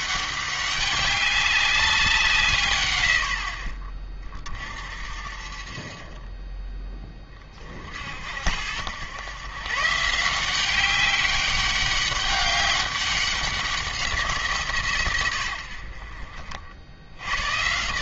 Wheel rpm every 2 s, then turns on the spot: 200, 140, 50, 20, 80, 180, 200, 150, 60.
none